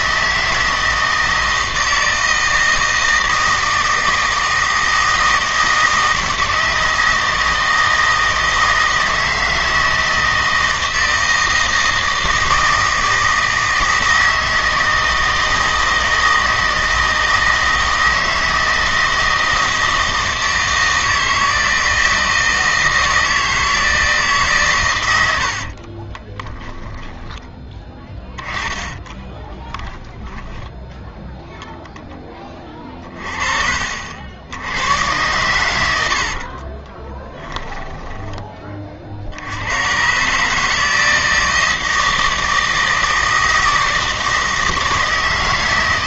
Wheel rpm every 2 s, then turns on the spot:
160, 160, 160, 160, 160, 160, 160, 160, 160, 160, 160, 160, 130, 10, 10, 0, 30, 110, 30, 30, 160, 160, 160.
26-30 36-38